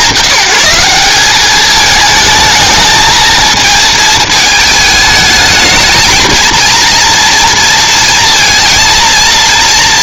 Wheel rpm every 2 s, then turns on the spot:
190, 220, 210, 220, 230.
none